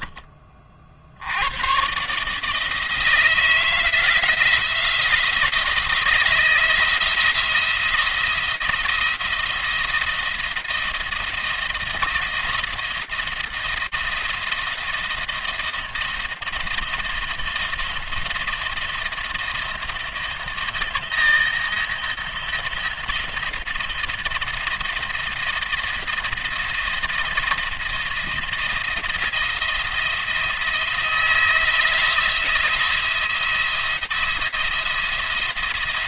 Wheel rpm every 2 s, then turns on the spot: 50, 160, 170, 160, 170, 170, 170, 160, 170, 170, 170, 170, 170, 170, 170, 170, 170, 170.
none